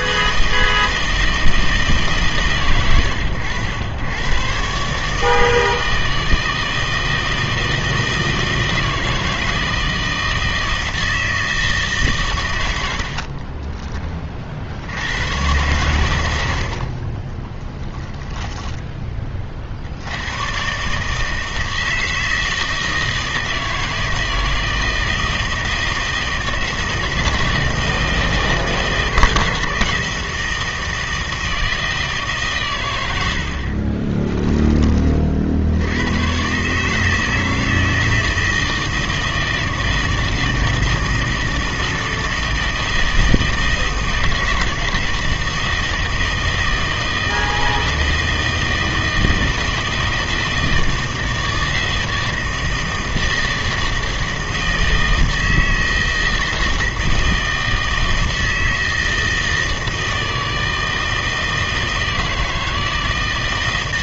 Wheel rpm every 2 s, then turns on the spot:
160, 130, 130, 160, 160, 160, 90, 50, 70, 10, 130, 160, 160, 160, 160, 160, 120, 10, 140, 160, 160, 160, 160, 160, 160, 160, 160, 160, 160, 160, 160, 160.
none